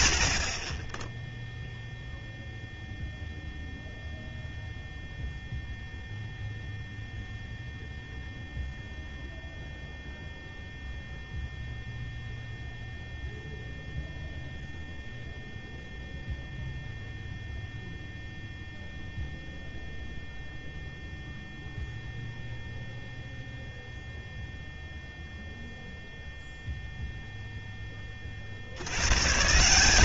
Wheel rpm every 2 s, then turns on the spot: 20, 0, 0, 0, 0, 0, 0, 0, 0, 0, 0, 0, 0, 0, 150.
none